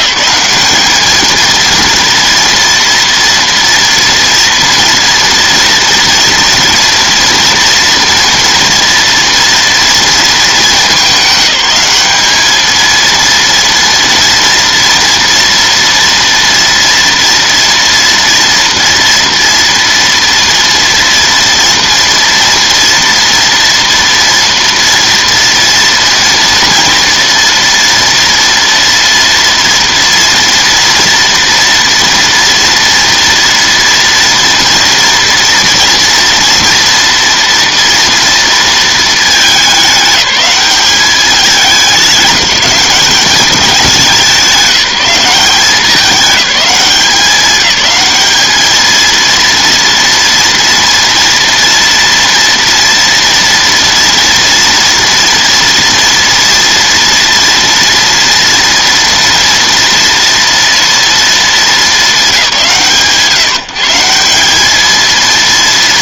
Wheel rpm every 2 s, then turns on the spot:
200, 230, 230, 240, 230, 220, 220, 240, 230, 230, 230, 240, 230, 230, 230, 230, 230, 230, 230, 230, 200, 200, 180, 200, 220, 230, 230, 240, 230, 230, 230, 170, 210.
none